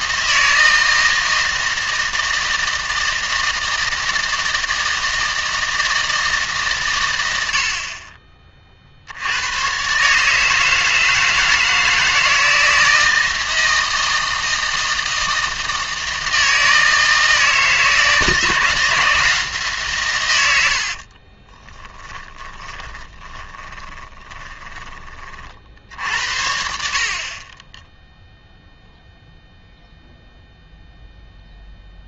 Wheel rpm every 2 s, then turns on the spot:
160, 160, 160, 130, 50, 160, 160, 160, 160, 160, 70, 20, 20, 60, 0, 0.
20-26